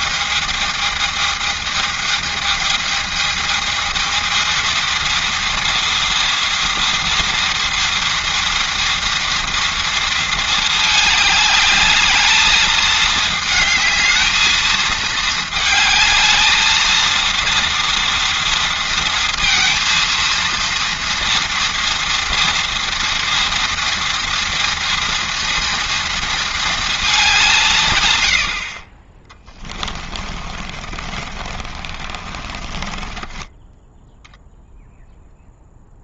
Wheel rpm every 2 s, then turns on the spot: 220, 220, 230, 230, 230, 220, 220, 220, 220, 230, 230, 230, 230, 220, 50, 30, 20, 0.
30-34